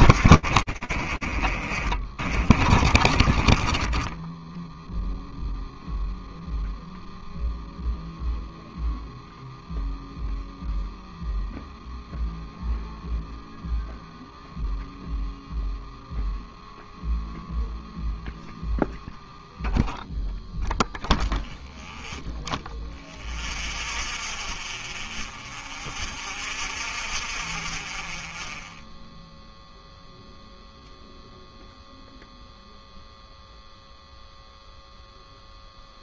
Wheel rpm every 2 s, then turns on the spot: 50, 20, 0, 0, 0, 0, 0, 0, 0, 0, 0, 0, 0, 0, 0, 0, 0, 0.
0-4